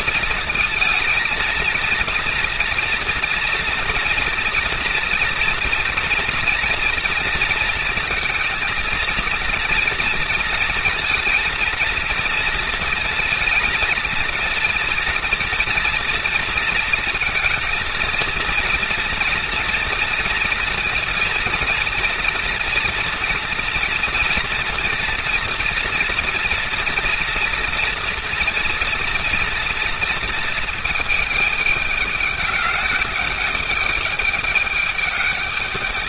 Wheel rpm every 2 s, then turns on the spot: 220, 230, 230, 230, 230, 230, 230, 230, 230, 230, 230, 230, 240, 230, 230, 230, 200, 210.
none